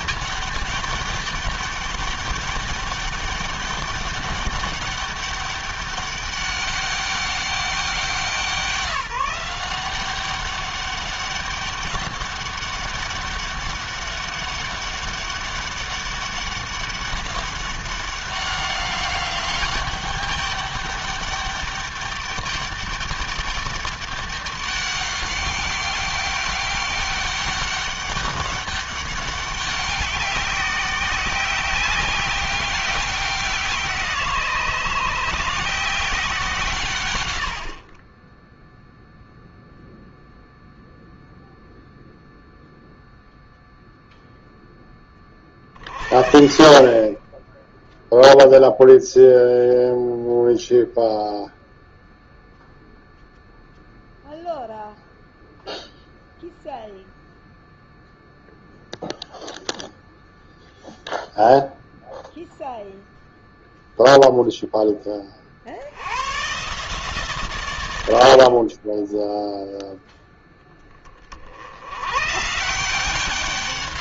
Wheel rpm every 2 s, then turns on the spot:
200, 200, 200, 200, 180, 200, 200, 200, 200, 200, 200, 200, 200, 190, 200, 190, 190, 160, 140, 0, 0, 0, 10, 40, 0, 0, 0, 0, 0, 0, 0, 0, 10, 130, 20, 10, 160.
none